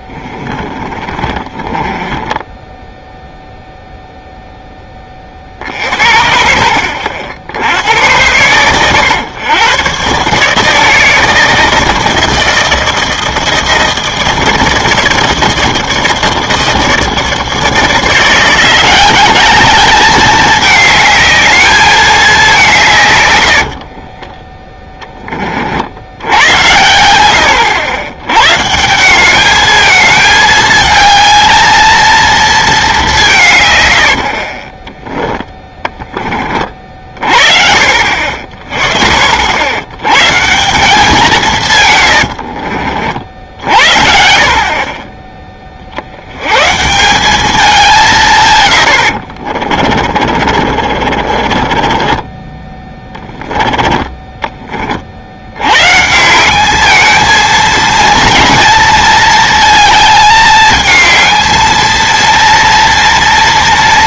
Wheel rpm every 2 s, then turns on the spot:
10, 20, 0, 50, 100, 140, 160, 160, 160, 160, 200, 200, 30, 80, 100, 220, 220, 80, 20, 50, 130, 90, 60, 70, 160, 40, 20, 20, 160, 230, 220, 230.
0-4 24-26 34-36 42-44 50-54